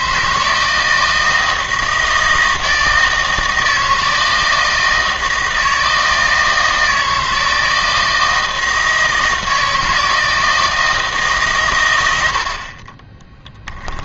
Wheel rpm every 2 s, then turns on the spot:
160, 160, 160, 160, 160, 160, 50.
none